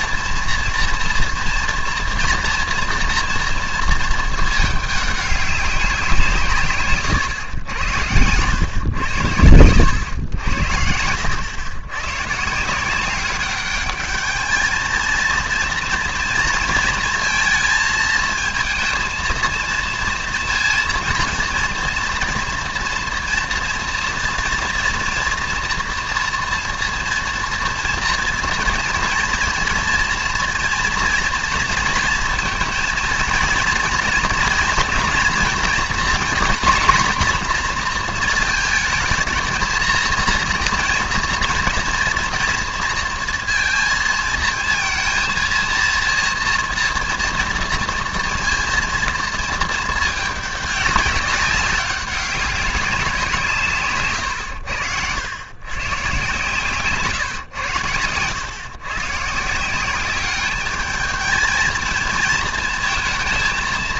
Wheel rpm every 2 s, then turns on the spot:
230, 230, 220, 150, 110, 80, 150, 220, 230, 230, 230, 230, 230, 230, 230, 230, 230, 240, 240, 220, 230, 230, 230, 230, 230, 210, 200, 90, 130, 120, 200, 220.
none